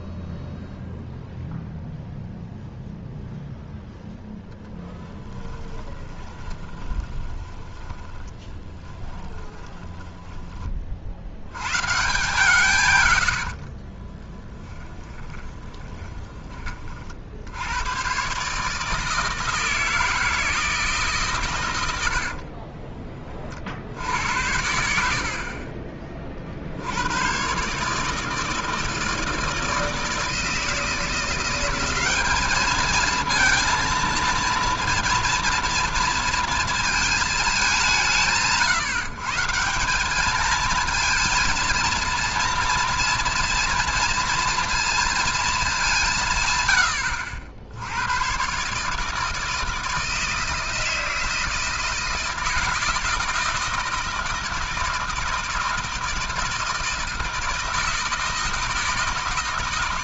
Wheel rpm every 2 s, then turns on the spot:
0, 0, 10, 20, 10, 30, 140, 10, 30, 150, 160, 30, 90, 60, 160, 160, 210, 230, 230, 160, 220, 230, 230, 110, 140, 160, 170, 160, 160, 160.
4-10 22-24 46-48